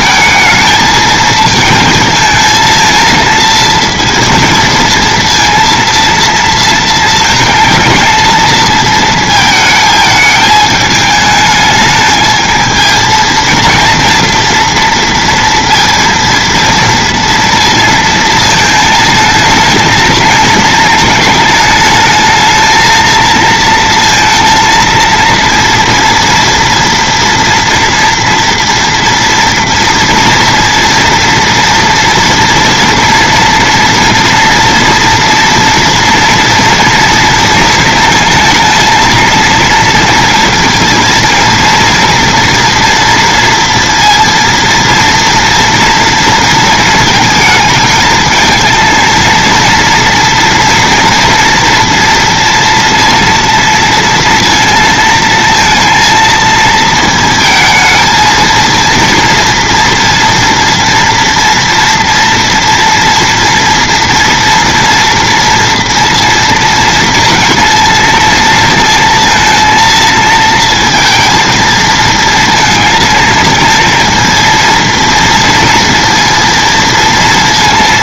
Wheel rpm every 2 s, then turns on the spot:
220, 230, 230, 230, 230, 210, 230, 230, 230, 220, 220, 220, 230, 230, 230, 230, 230, 230, 230, 230, 230, 230, 230, 220, 230, 240, 230, 230, 220, 230, 230, 230, 230, 230, 230, 230, 230, 230, 230.
none